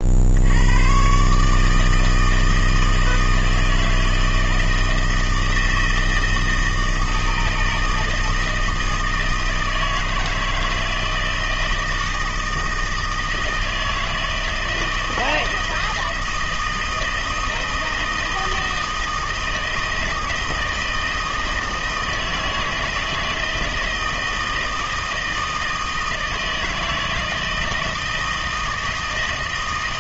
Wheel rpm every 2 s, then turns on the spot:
100, 160, 160, 160, 160, 160, 160, 160, 160, 160, 160, 160, 160, 160, 160.
none